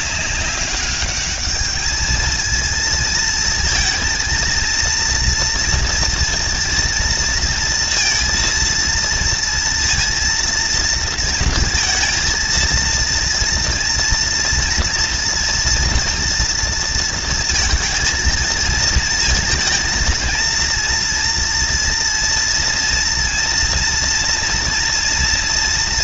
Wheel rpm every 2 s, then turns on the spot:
200, 220, 230, 230, 230, 230, 230, 230, 230, 230, 230, 230, 240.
none